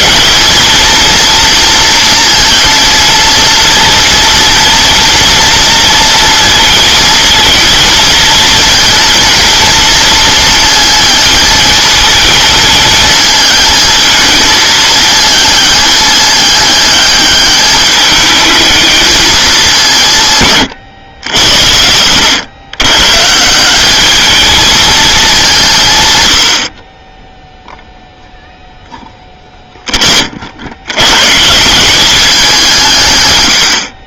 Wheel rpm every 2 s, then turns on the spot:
230, 230, 230, 230, 230, 230, 220, 220, 210, 210, 130, 120, 220, 60, 0, 80, 170.
none